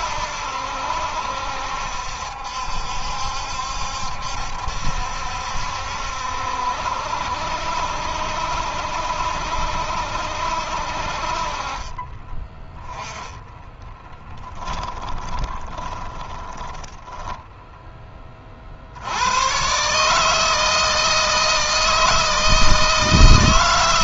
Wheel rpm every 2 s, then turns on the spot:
70, 70, 70, 70, 70, 50, 10, 20, 10, 80, 160, 160.
14-18